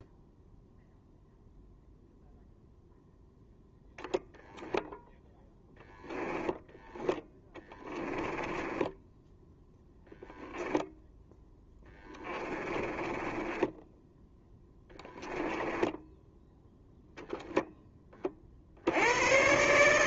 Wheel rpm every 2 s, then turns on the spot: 0, 0, 0, 10, 10, 0, 20, 10, 0, 50.
6-10 12-16